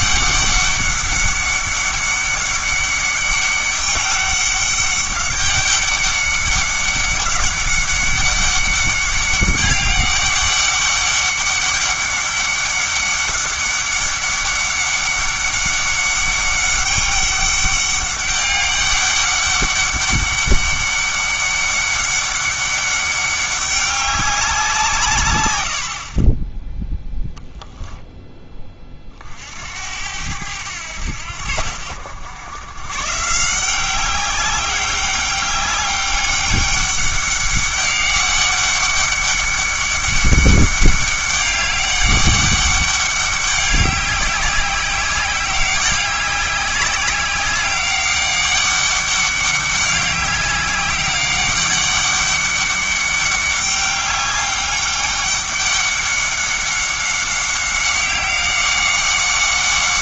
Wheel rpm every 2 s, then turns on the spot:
200, 200, 200, 200, 200, 200, 200, 200, 200, 200, 200, 200, 170, 10, 20, 90, 120, 200, 200, 200, 200, 200, 200, 190, 200, 200, 200, 200, 200, 190.
none